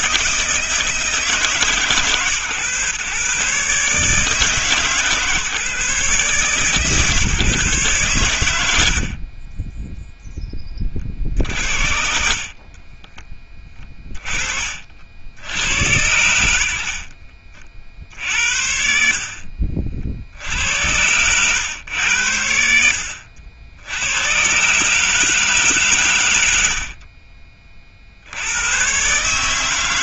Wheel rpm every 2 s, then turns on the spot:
160, 120, 150, 140, 90, 10, 50, 40, 70, 60, 80, 80, 130, 70, 100.
none